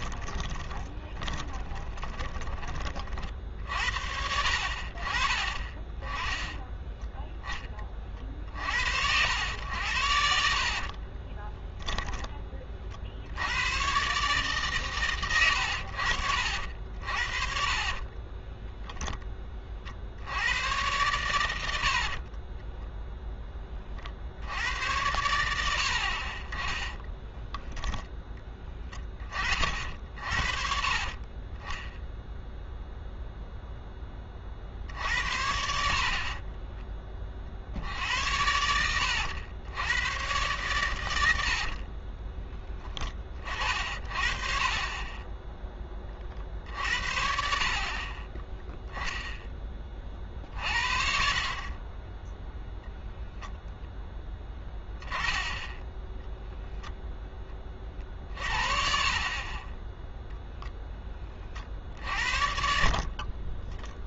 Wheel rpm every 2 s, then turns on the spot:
20, 20, 60, 10, 60, 60, 30, 140, 60, 10, 100, 10, 90, 20, 10, 50, 0, 50, 30, 80, 110, 20, 30, 60, 10, 50, 0, 10, 0, 50, 0, 50.
0-2 6-8 10-12 16-20 26-28 36-38